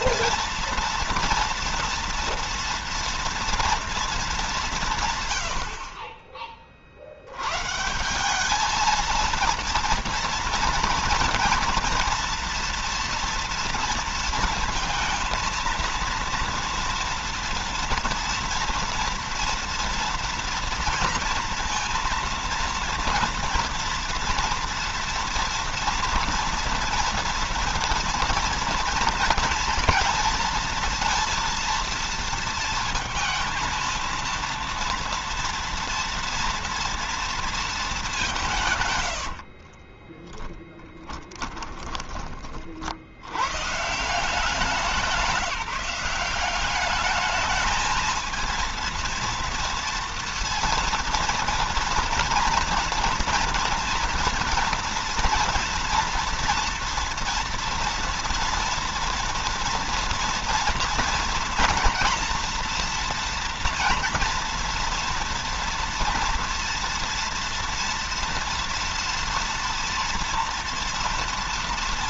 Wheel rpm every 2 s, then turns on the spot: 230, 230, 190, 40, 210, 230, 230, 230, 230, 230, 230, 230, 230, 230, 230, 230, 230, 230, 230, 150, 10, 40, 180, 200, 230, 230, 230, 230, 230, 230, 230, 230, 230, 230, 230, 230.
40-42